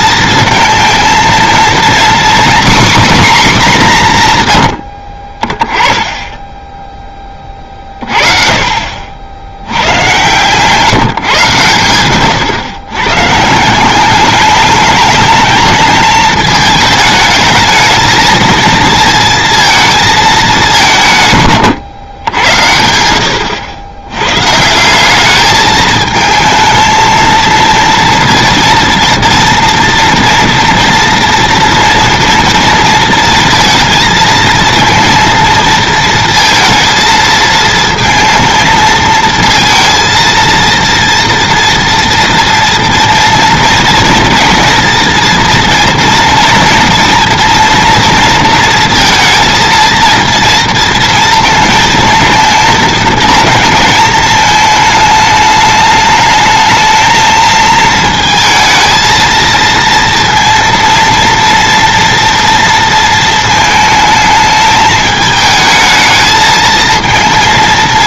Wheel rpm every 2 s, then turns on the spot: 230, 260, 90, 10, 50, 160, 120, 210, 220, 230, 180, 80, 160, 220, 230, 230, 230, 230, 230, 220, 230, 230, 230, 230, 230, 230, 220, 220, 220, 220, 230, 230, 220, 220.
none